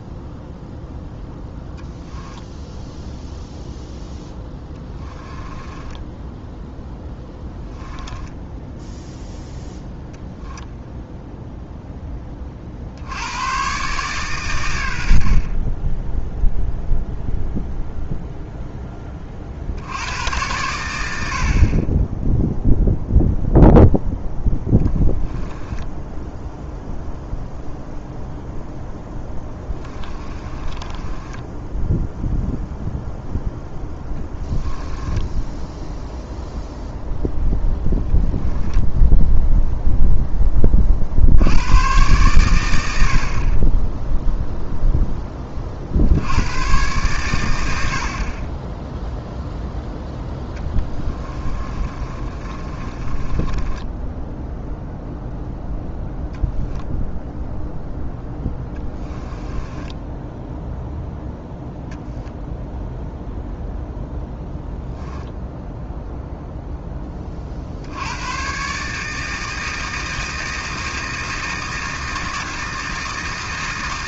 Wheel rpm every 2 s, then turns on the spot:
0, 0, 10, 0, 0, 10, 60, 90, 0, 0, 100, 0, 10, 0, 10, 20, 0, 10, 0, 10, 30, 90, 0, 120, 10, 10, 30, 0, 0, 10, 0, 0, 0, 0, 140, 160, 160.
4-6 24-26 28-32 34-36 38-40 50-54 58-60